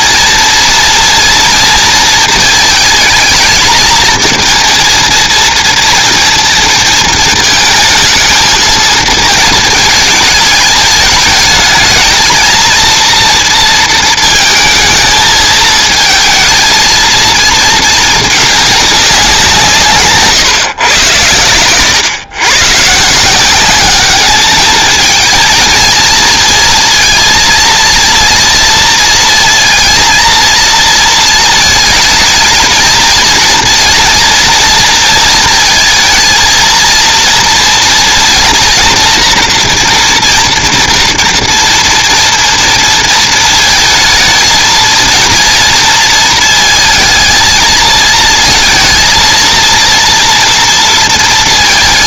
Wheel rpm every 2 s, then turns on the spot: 230, 220, 230, 230, 220, 220, 230, 220, 220, 210, 130, 140, 220, 230, 230, 230, 220, 230, 230, 240, 230, 230, 230, 220, 230, 230.
none